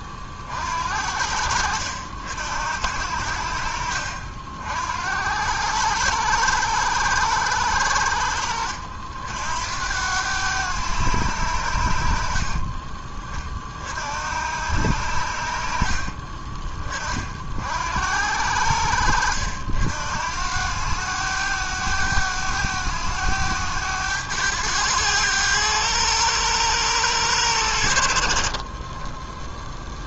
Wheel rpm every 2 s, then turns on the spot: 40, 70, 60, 100, 70, 100, 40, 80, 30, 80, 80, 100, 100, 100, 40.
12-14